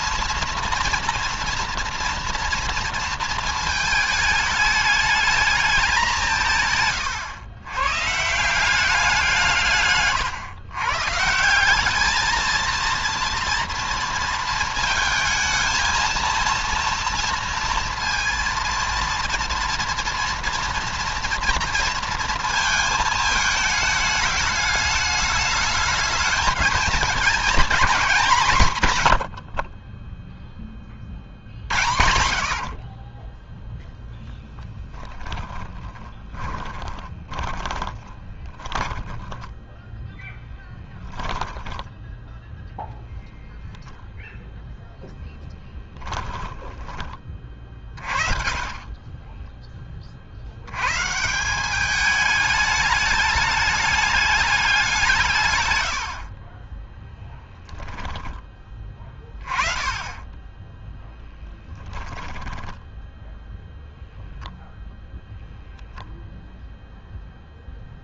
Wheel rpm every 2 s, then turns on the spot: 230, 230, 210, 140, 180, 140, 230, 220, 230, 230, 240, 220, 210, 220, 130, 40, 40, 10, 20, 10, 10, 10, 10, 30, 30, 140, 210, 180, 10, 20, 10, 10, 10, 0.
34-42 44-46 48-50 56-58 60-64